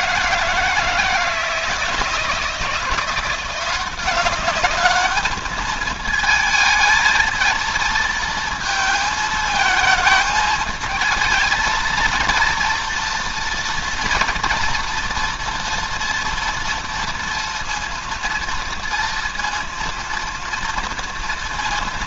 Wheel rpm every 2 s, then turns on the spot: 160, 170, 200, 220, 220, 220, 230, 230, 230, 230, 230.
none